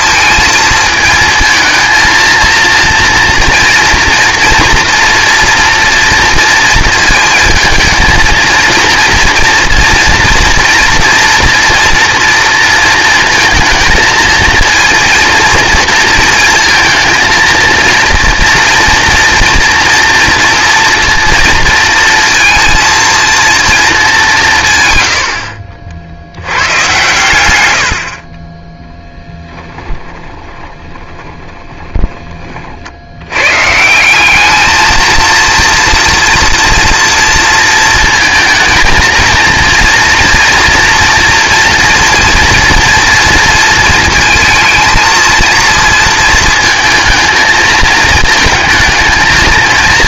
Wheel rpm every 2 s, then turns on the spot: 220, 230, 230, 230, 230, 230, 230, 230, 230, 230, 230, 230, 120, 120, 10, 20, 80, 220, 230, 230, 230, 230, 220, 220, 220.
30-32